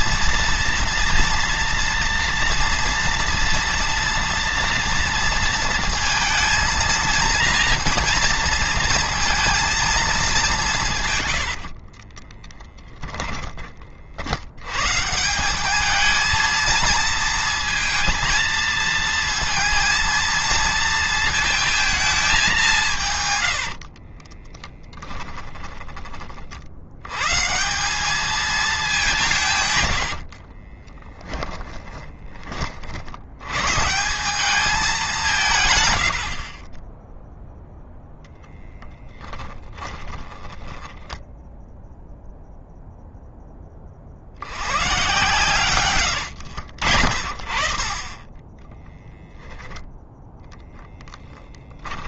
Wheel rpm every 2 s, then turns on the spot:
230, 230, 230, 230, 230, 160, 10, 130, 220, 220, 230, 170, 20, 80, 200, 30, 50, 200, 20, 10, 30, 0, 120, 70, 10, 10.
12-14 24-26 30-32 40-42 48-50